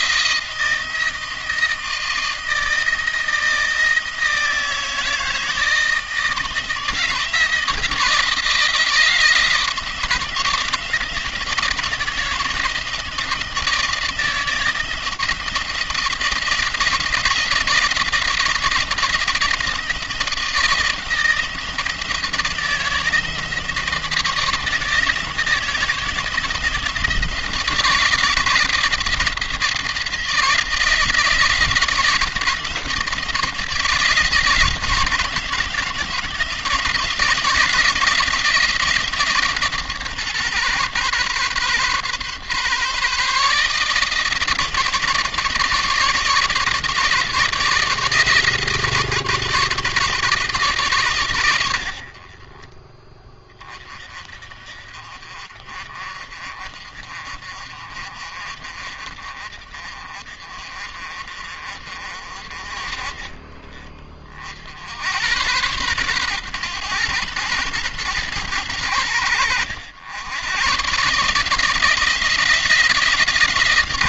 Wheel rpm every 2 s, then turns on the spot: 170, 160, 160, 160, 160, 160, 160, 160, 160, 160, 160, 160, 160, 160, 170, 160, 160, 160, 170, 160, 130, 140, 150, 150, 160, 140, 30, 40, 50, 50, 50, 30, 80, 120, 100, 130, 160.
none